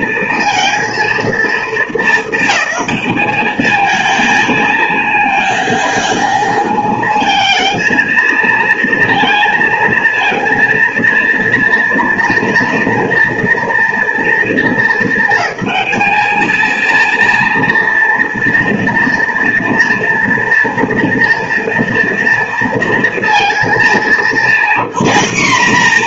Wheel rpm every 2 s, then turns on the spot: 230, 220, 220, 230, 230, 230, 230, 230, 210, 230, 230, 230, 200.
none